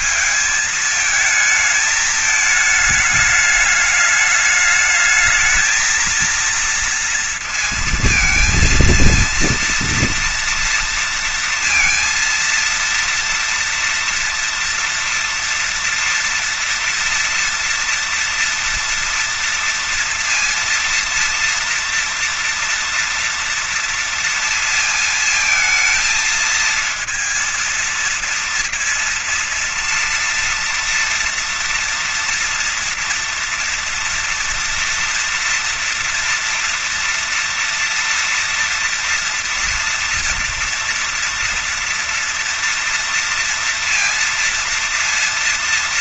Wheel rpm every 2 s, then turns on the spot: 220, 210, 210, 230, 230, 230, 230, 230, 240, 230, 230, 230, 230, 230, 230, 240, 240, 240, 240, 230, 230, 230, 230.
none